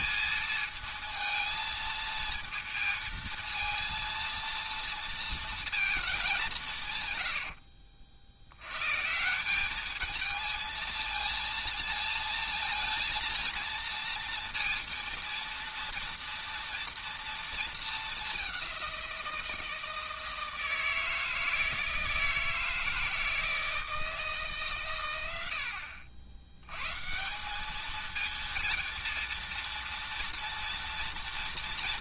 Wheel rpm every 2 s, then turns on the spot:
230, 230, 230, 170, 110, 230, 230, 230, 230, 190, 160, 160, 140, 100, 230, 230.
none